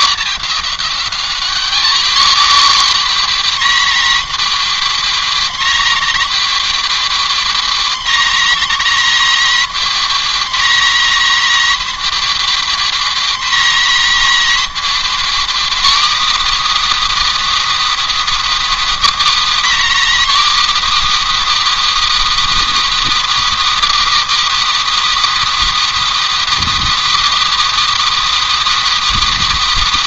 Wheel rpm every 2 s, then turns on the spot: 210, 260, 270, 270, 270, 270, 270, 280, 320, 330, 310, 330, 330, 330, 330.
none